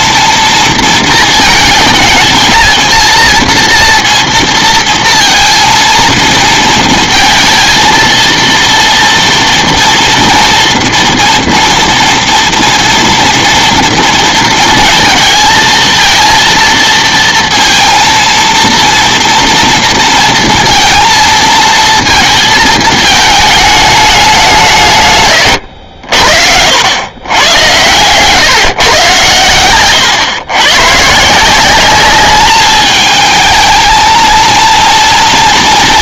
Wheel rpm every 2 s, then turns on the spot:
230, 220, 230, 220, 230, 240, 230, 230, 230, 230, 230, 220, 170, 80, 130, 120, 210, 230.
none